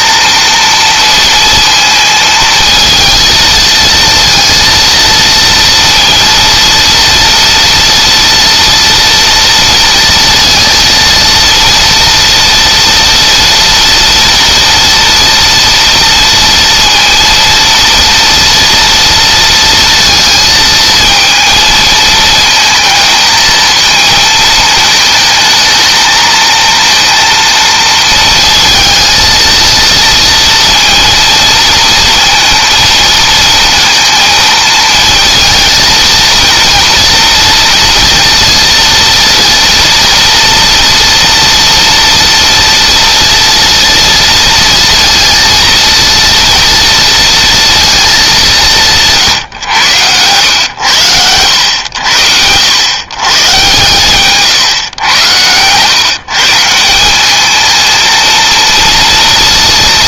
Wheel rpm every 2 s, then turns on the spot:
230, 230, 230, 230, 230, 230, 230, 230, 230, 230, 230, 220, 220, 230, 230, 230, 230, 220, 230, 230, 230, 230, 230, 230, 160, 90, 120, 110, 190, 230.
none